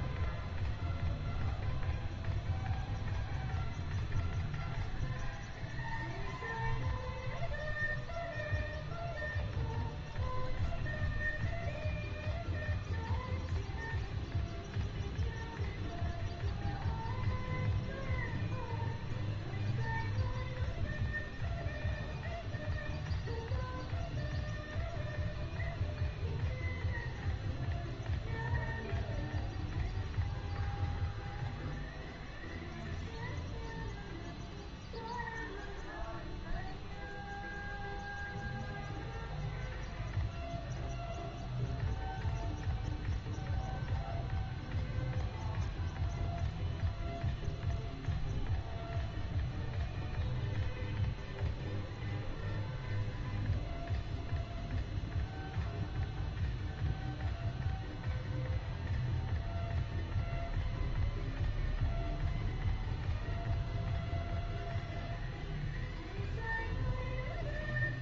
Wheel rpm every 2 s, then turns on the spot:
0, 0, 0, 0, 0, 0, 0, 0, 0, 0, 0, 0, 0, 0, 0, 0, 0, 0, 0, 0, 0, 0, 0, 0, 0, 0, 0, 0, 0, 0, 0, 0, 0, 0.
none